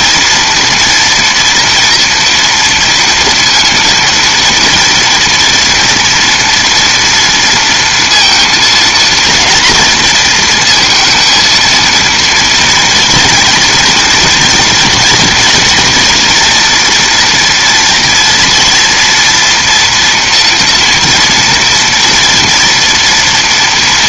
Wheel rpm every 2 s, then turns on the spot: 230, 230, 230, 230, 230, 230, 230, 230, 240, 230, 240, 230.
none